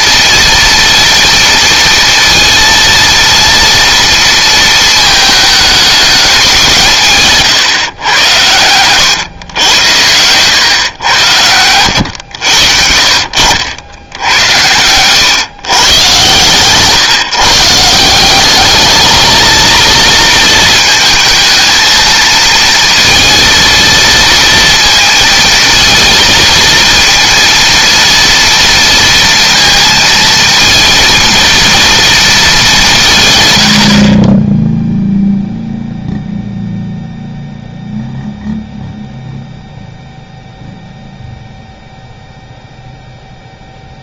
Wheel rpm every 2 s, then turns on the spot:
230, 230, 220, 170, 110, 110, 60, 110, 150, 210, 220, 230, 220, 230, 230, 230, 180, 0, 0, 0, 0, 0.
none